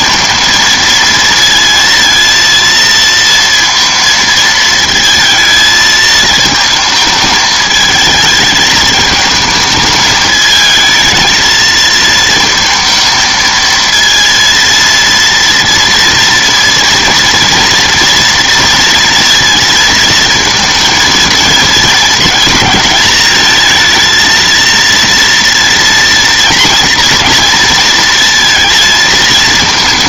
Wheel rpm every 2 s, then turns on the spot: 230, 230, 220, 220, 220, 220, 220, 230, 230, 230, 220, 220, 230, 230, 230.
none